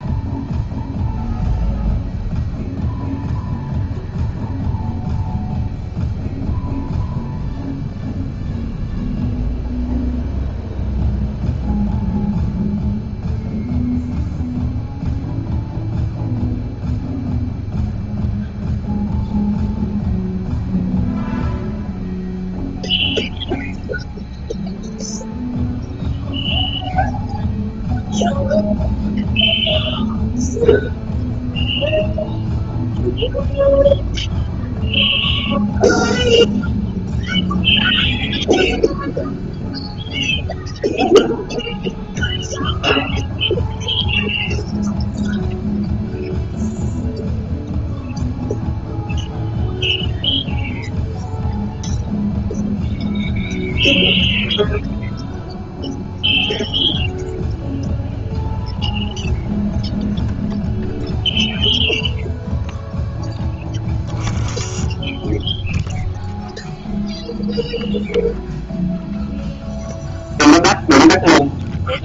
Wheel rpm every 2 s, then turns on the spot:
0, 0, 0, 0, 0, 0, 0, 0, 0, 0, 0, 0, 0, 0, 0, 0, 0, 0, 0, 0, 0, 0, 0, 0, 0, 0, 0, 0, 0, 0, 0, 0, 10, 0, 0, 0.
none